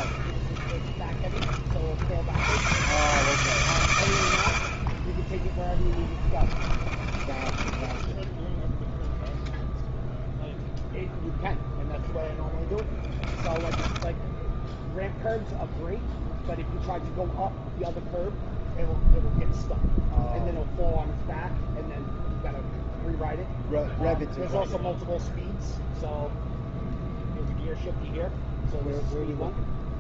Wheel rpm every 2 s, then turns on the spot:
40, 110, 50, 20, 10, 0, 10, 10, 0, 0, 0, 0, 0, 0, 0.
6-10 12-14